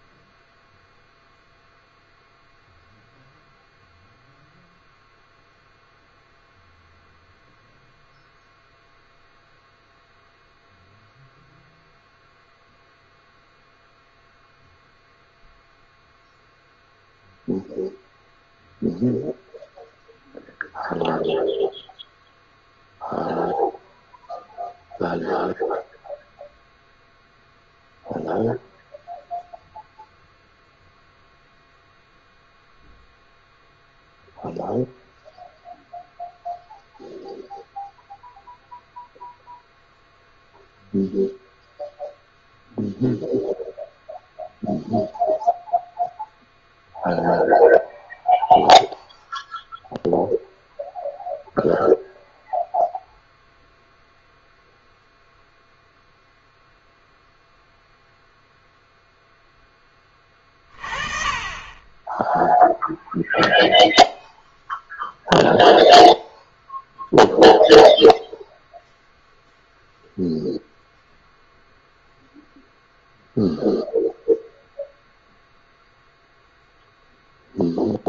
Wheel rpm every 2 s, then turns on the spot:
0, 0, 0, 0, 0, 0, 0, 0, 0, 0, 0, 0, 0, 0, 0, 0, 0, 0, 0, 0, 0, 0, 0, 0, 0, 0, 0, 0, 0, 0, 30, 0, 0, 0, 0, 0, 0, 0, 0.
none